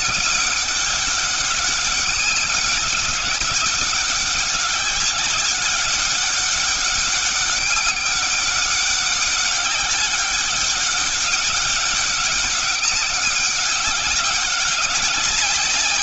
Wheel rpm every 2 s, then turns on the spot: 200, 190, 200, 200, 190, 200, 200, 190.
none